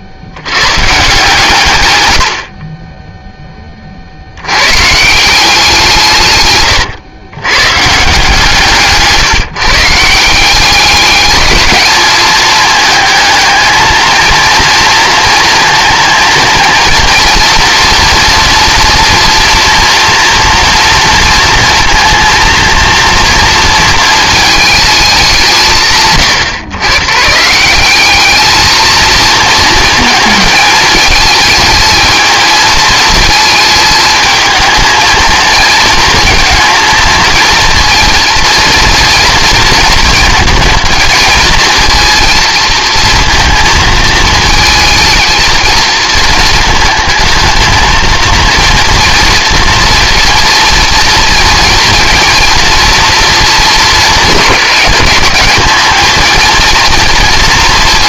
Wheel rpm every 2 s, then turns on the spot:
120, 30, 160, 120, 160, 200, 220, 230, 230, 230, 230, 230, 210, 120, 230, 220, 220, 220, 230, 230, 220, 230, 220, 220, 230, 230, 230, 210, 230.
none